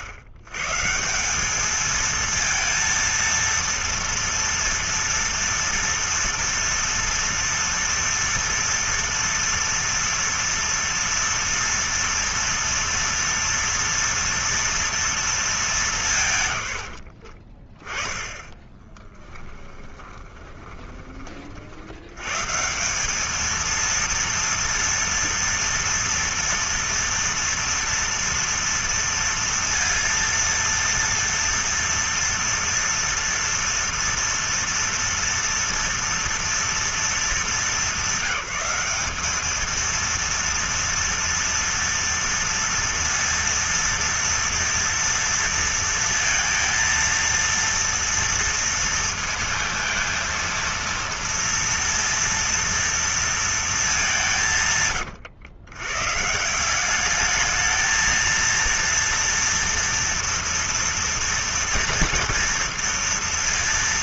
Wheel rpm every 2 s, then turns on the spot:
100, 230, 230, 230, 230, 240, 230, 230, 130, 20, 30, 130, 230, 230, 230, 230, 230, 230, 230, 200, 230, 230, 230, 230, 230, 230, 230, 150, 170, 230, 230, 230.
18-22